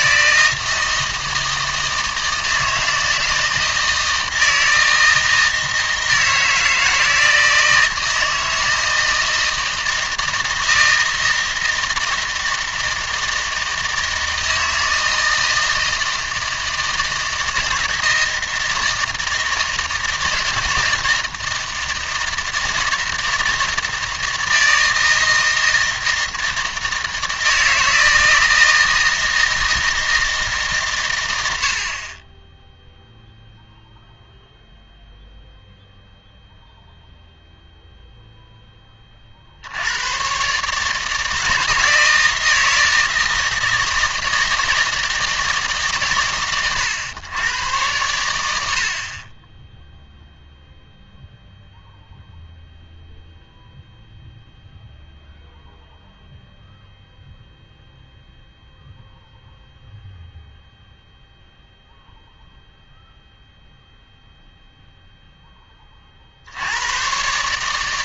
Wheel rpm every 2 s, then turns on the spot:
160, 160, 160, 160, 160, 160, 160, 160, 160, 160, 160, 160, 160, 160, 160, 140, 0, 0, 0, 10, 140, 160, 160, 120, 70, 0, 0, 0, 0, 0, 0, 0, 0, 90.
none